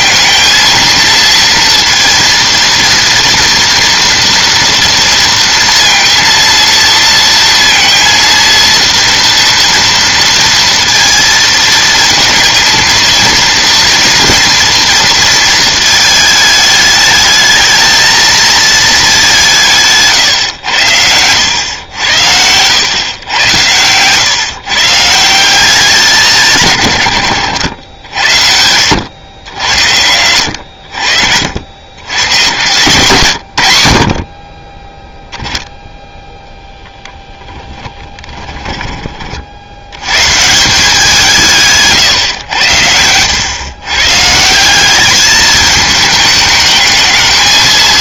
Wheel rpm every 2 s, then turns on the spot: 230, 230, 230, 230, 230, 230, 230, 230, 210, 220, 100, 110, 150, 140, 90, 60, 120, 10, 10, 20, 170, 100, 190, 220.
38-40